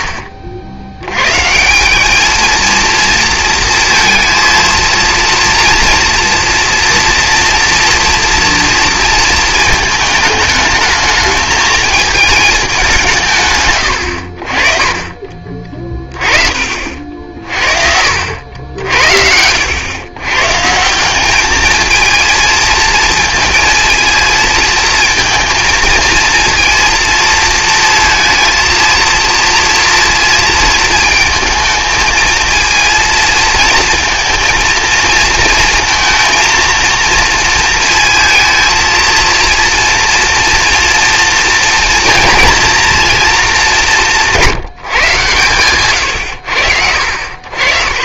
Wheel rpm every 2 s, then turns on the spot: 70, 220, 230, 230, 230, 220, 200, 40, 50, 70, 150, 230, 220, 230, 230, 230, 230, 220, 230, 230, 240, 230, 160, 70.
16-18